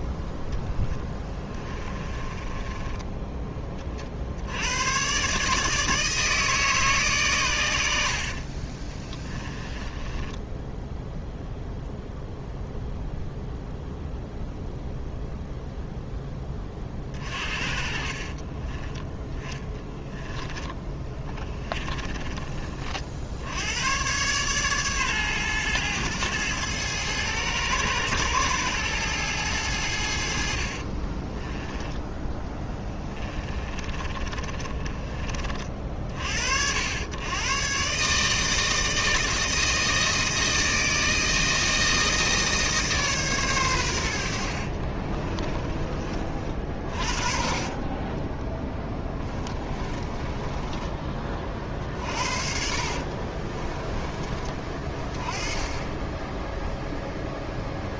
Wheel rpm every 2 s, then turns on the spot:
0, 20, 90, 150, 30, 10, 0, 0, 30, 20, 10, 40, 130, 110, 110, 50, 20, 30, 70, 160, 160, 150, 50, 40, 10, 20, 60, 30, 0.
2-4 8-12 18-22 30-36 44-46 48-54